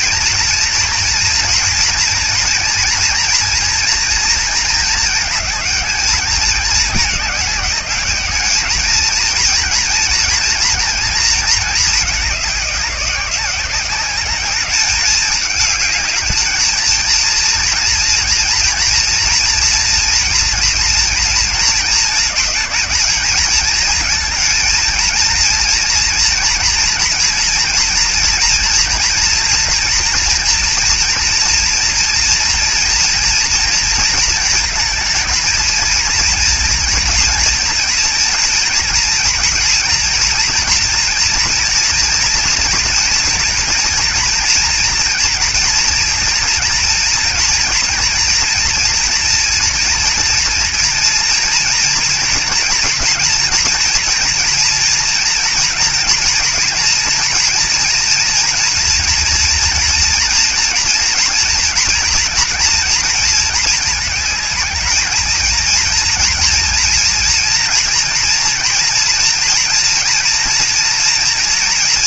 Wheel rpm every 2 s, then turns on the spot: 230, 230, 220, 210, 210, 230, 190, 210, 230, 230, 230, 220, 230, 230, 230, 230, 230, 220, 230, 230, 230, 230, 240, 230, 230, 230, 240, 240, 230, 230, 230, 230, 220, 240, 240, 230.
none